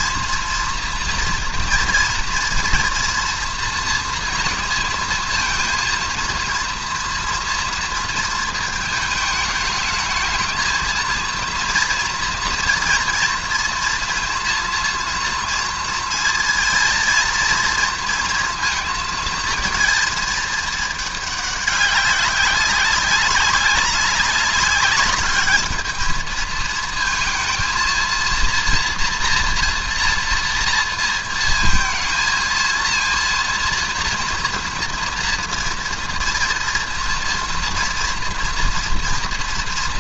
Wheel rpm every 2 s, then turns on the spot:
230, 240, 230, 230, 220, 210, 230, 240, 230, 230, 220, 190, 200, 220, 230, 230, 230, 230, 230, 230.
none